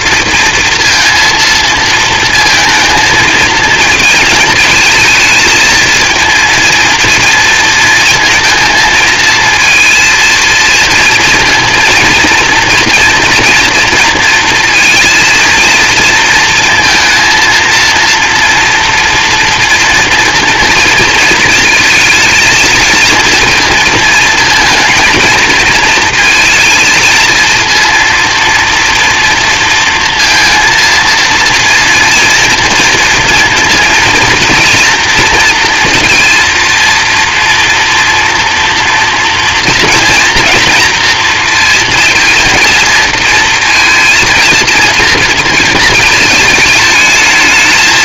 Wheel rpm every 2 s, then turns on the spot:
230, 230, 220, 230, 220, 230, 230, 230, 230, 230, 230, 230, 230, 230, 230, 230, 230, 230, 230, 230, 240, 230, 230, 220.
none